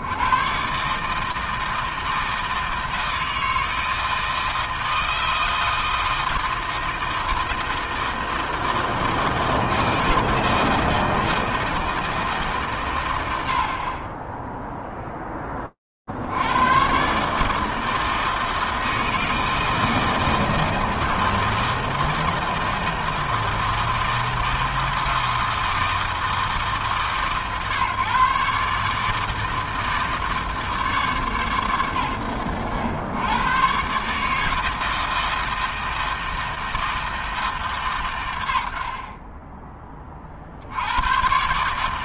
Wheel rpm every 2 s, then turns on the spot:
120, 160, 160, 160, 160, 160, 150, 10, 120, 160, 160, 160, 160, 140, 150, 150, 80, 160, 160, 80, 60.
none